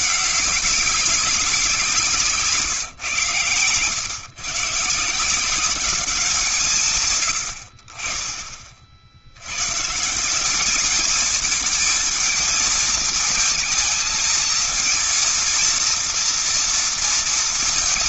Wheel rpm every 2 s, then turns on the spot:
200, 160, 140, 180, 30, 170, 220, 230, 230.
none